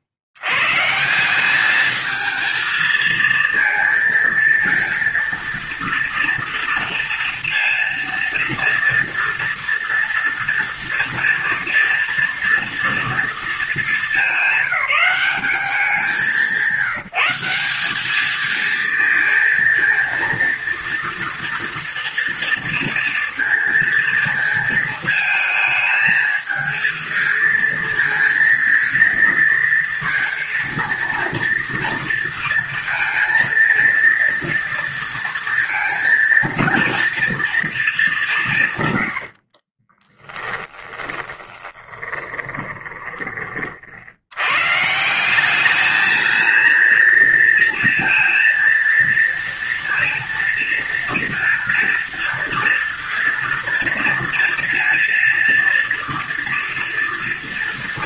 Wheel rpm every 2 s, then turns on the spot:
80, 220, 230, 230, 240, 230, 230, 190, 170, 220, 230, 230, 220, 220, 220, 230, 230, 230, 230, 170, 10, 20, 110, 220, 230, 230, 230, 230, 230.
40-44